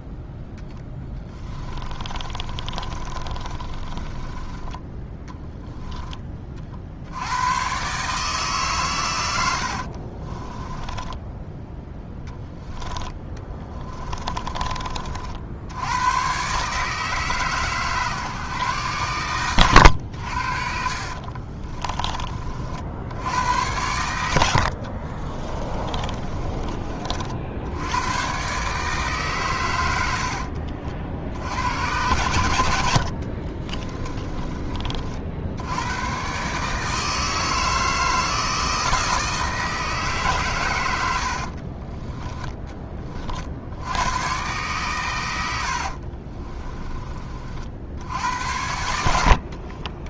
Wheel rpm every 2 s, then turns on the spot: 10, 30, 10, 60, 120, 10, 10, 40, 150, 130, 60, 60, 50, 30, 140, 60, 70, 40, 150, 160, 110, 20, 120, 30, 70.
0-4 10-12 20-22 24-26 46-48